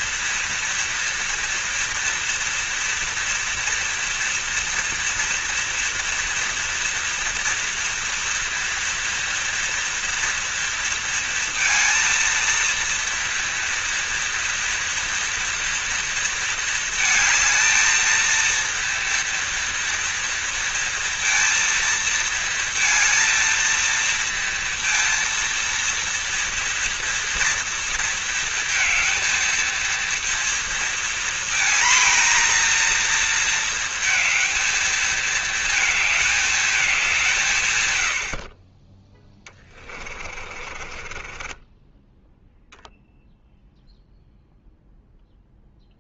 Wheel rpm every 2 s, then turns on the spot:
240, 230, 230, 230, 230, 230, 230, 230, 230, 230, 230, 230, 230, 230, 230, 230, 230, 230, 220, 50, 30, 0, 0.
40-42